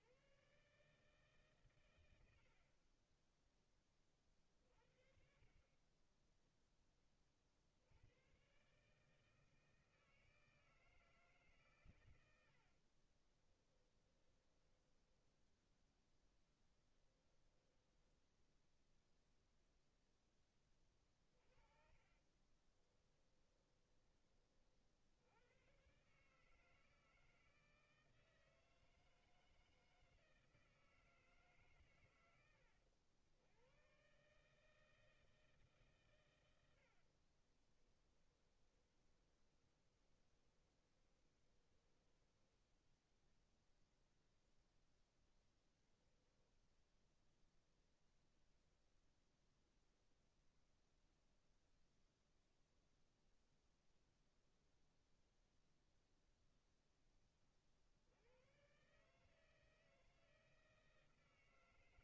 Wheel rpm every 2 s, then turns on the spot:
140, 10, 50, 20, 140, 160, 50, 10, 10, 0, 20, 20, 60, 160, 160, 160, 90, 160, 80, 20, 20, 10, 10, 0, 10, 0, 0, 0, 10, 130, 150.
12-16 22-24 36-42